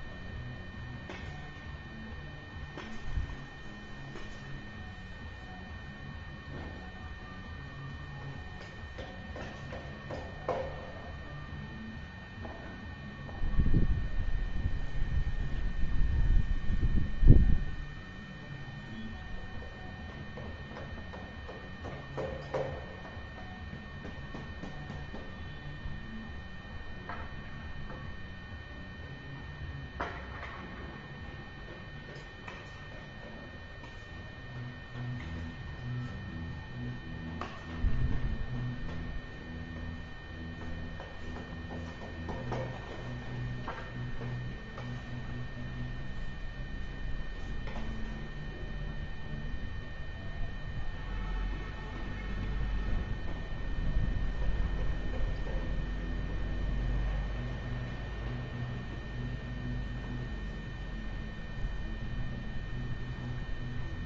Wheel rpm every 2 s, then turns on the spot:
0, 0, 0, 0, 0, 0, 0, 0, 0, 0, 0, 0, 0, 0, 0, 0, 0, 0, 0, 0, 0, 0, 0, 0, 0, 0, 0, 0, 0, 0, 0, 0.
none